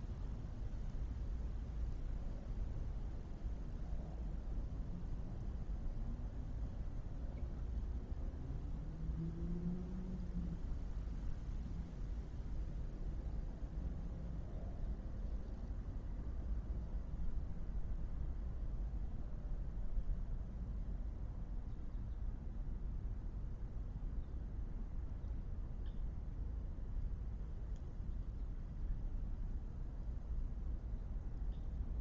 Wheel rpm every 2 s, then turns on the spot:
0, 0, 0, 0, 0, 0, 0, 0, 0, 0, 0, 0, 0, 0, 0, 0.
none